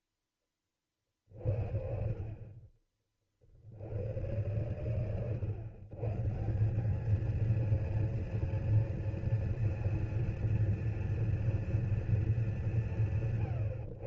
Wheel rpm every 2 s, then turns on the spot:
40, 40, 110, 230, 230, 230, 150.
none